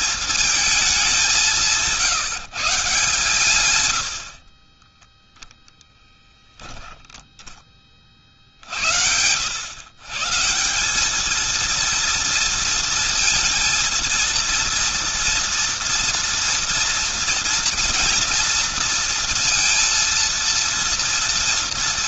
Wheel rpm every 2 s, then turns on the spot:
220, 160, 50, 10, 60, 160, 230, 230, 230, 230, 230.
none